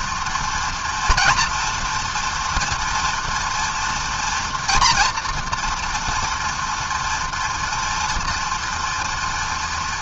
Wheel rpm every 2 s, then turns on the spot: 230, 230, 230, 240, 230.
none